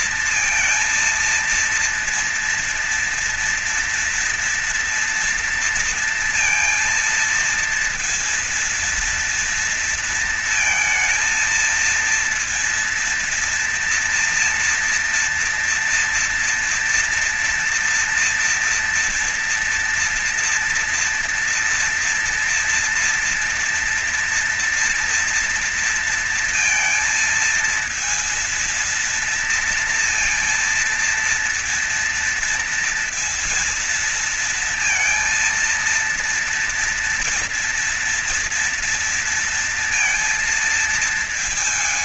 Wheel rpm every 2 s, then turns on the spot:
230, 230, 230, 230, 230, 220, 230, 230, 230, 230, 230, 230, 230, 230, 230, 230, 230, 230, 230, 230, 220.
none